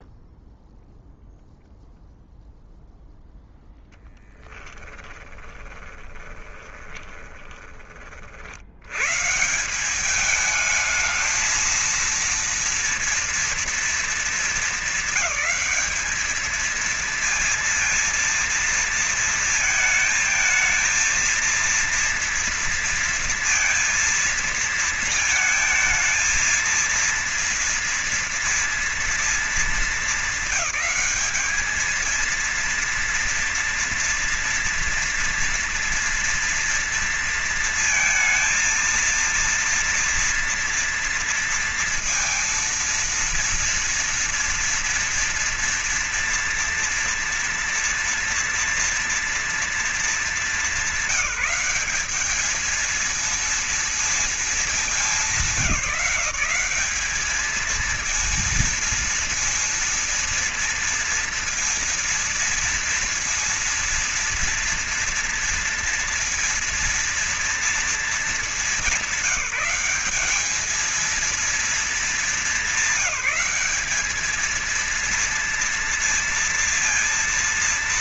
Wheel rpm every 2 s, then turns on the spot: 0, 0, 20, 20, 70, 210, 230, 210, 220, 230, 220, 230, 230, 230, 230, 210, 230, 230, 230, 220, 230, 230, 240, 230, 240, 210, 210, 210, 190, 230, 230, 230, 230, 230, 220, 220, 200, 220, 230.
4-8